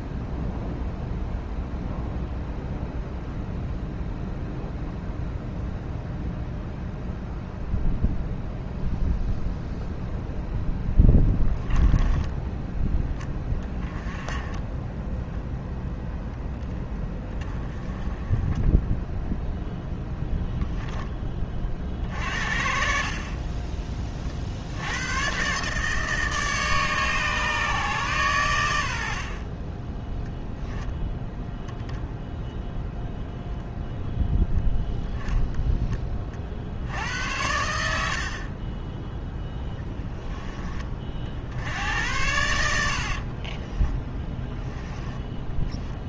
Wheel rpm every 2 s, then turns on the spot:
0, 0, 0, 0, 0, 10, 20, 10, 10, 10, 10, 50, 80, 150, 90, 10, 0, 0, 70, 20, 30, 70, 10.
14-16 38-40 42-46